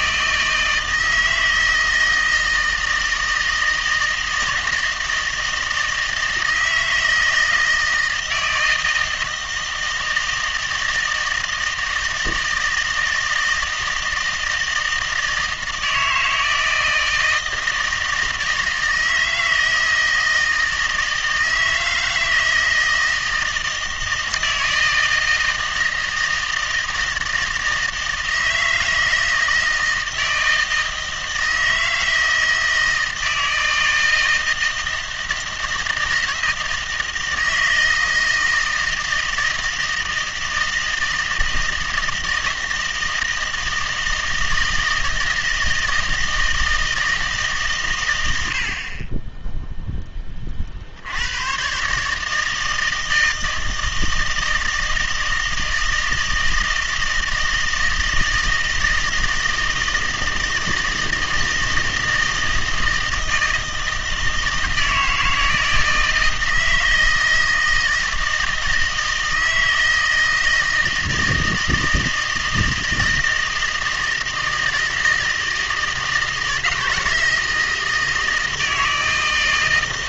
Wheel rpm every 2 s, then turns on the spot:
160, 160, 160, 160, 160, 160, 160, 160, 160, 160, 160, 160, 160, 160, 160, 160, 160, 160, 160, 160, 160, 160, 160, 160, 70, 40, 160, 160, 160, 160, 160, 160, 160, 160, 160, 160, 160, 160, 160, 160.
none